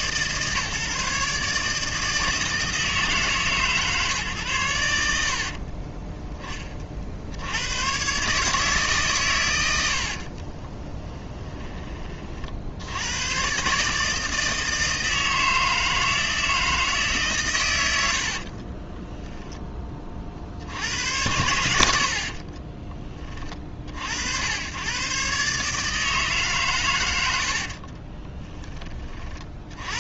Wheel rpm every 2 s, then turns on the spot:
140, 150, 90, 40, 140, 20, 80, 160, 160, 20, 80, 20, 100, 120, 20.
10-12 18-20 22-24